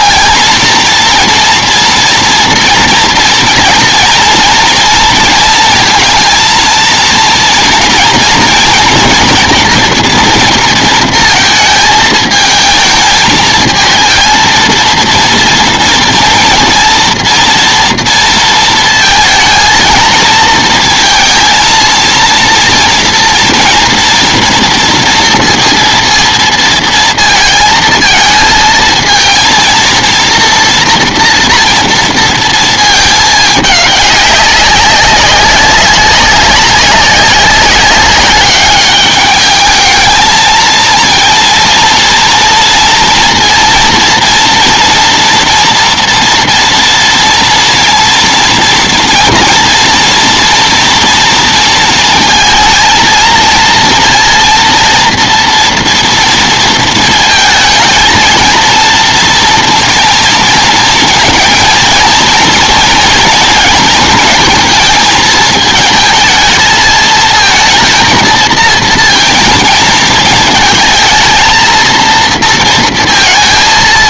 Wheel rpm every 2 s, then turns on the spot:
230, 230, 230, 230, 240, 230, 220, 230, 230, 230, 230, 230, 230, 230, 220, 240, 220, 190, 190, 200, 220, 230, 230, 230, 230, 230, 230, 230, 230, 230, 230, 230, 230, 220, 220, 220, 230.
none